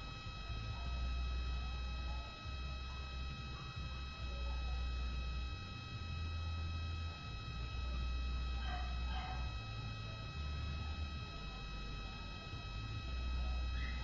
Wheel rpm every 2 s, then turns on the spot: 0, 0, 0, 0, 0, 0, 0.
none